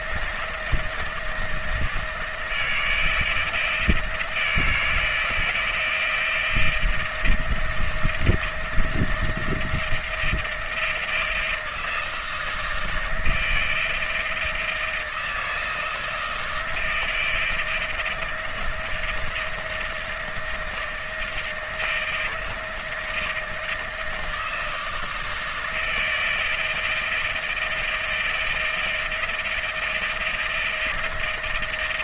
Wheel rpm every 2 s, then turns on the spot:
160, 170, 160, 160, 160, 170, 160, 160, 160, 160, 170, 160, 160, 170, 160, 170.
none